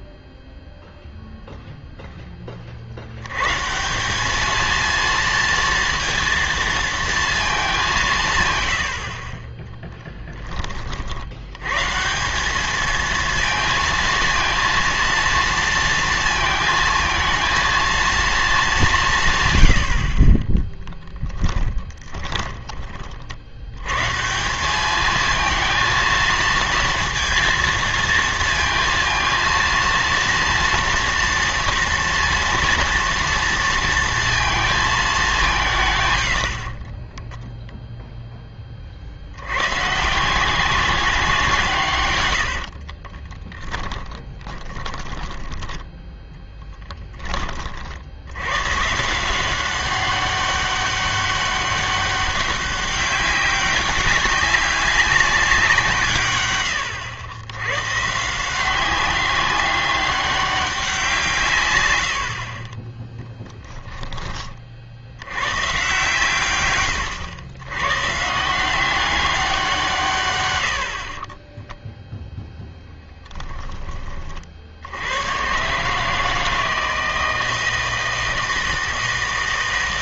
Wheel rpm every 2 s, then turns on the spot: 0, 40, 230, 230, 110, 30, 210, 230, 230, 200, 10, 20, 200, 230, 230, 230, 230, 220, 30, 30, 190, 60, 10, 10, 130, 200, 190, 200, 100, 180, 190, 30, 40, 120, 180, 70, 0, 70, 160, 160.
22-24 36-38 42-48 70-72